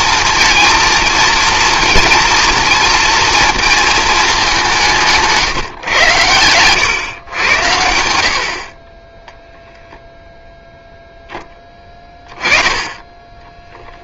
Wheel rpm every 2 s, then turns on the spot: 230, 230, 170, 120, 30, 0, 20.
none